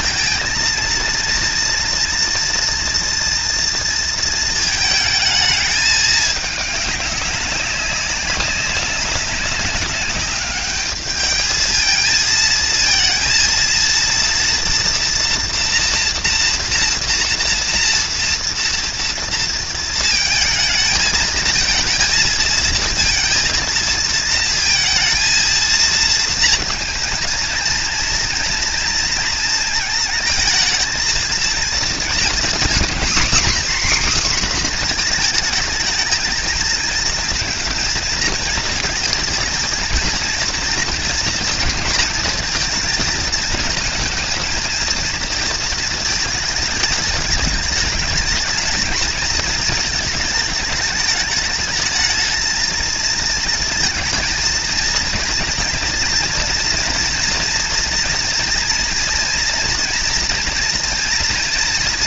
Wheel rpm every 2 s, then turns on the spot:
220, 230, 220, 200, 200, 210, 230, 230, 230, 230, 220, 230, 230, 230, 230, 220, 250, 250, 230, 230, 230, 230, 230, 210, 210, 210, 220, 230, 230, 240, 240.
none